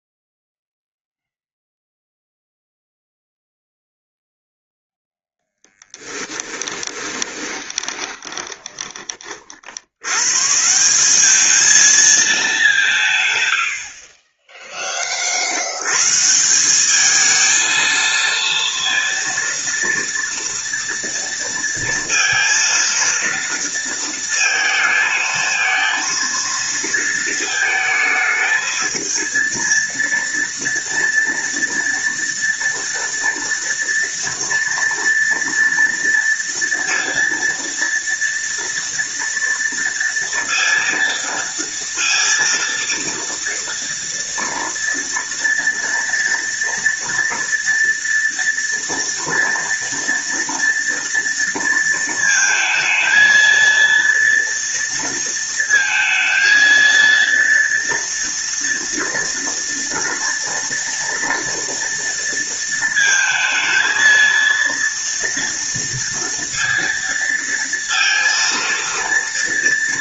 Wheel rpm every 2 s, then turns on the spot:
0, 0, 0, 20, 20, 170, 170, 10, 190, 230, 230, 230, 230, 230, 220, 230, 230, 230, 230, 230, 230, 230, 230, 230, 230, 230, 220, 230, 230, 230, 230, 220, 230, 230, 230.
6-10